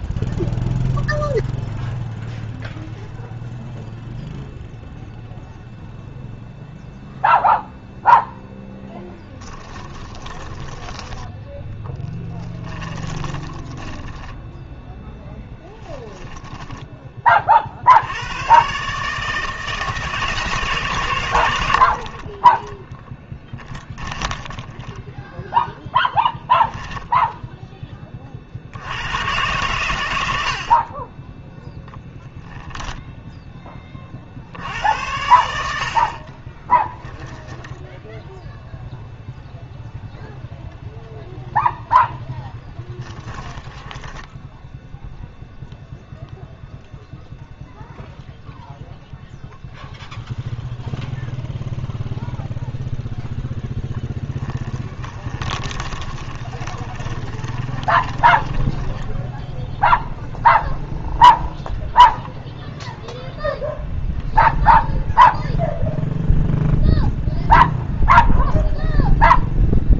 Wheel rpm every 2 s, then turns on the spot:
0, 0, 0, 0, 10, 10, 30, 10, 30, 150, 120, 10, 0, 10, 110, 20, 10, 90, 0, 0, 0, 10, 0, 0, 0, 0, 0, 20, 20, 10, 0, 0, 0, 0, 0.
8-10 12-14 22-24 42-44 54-60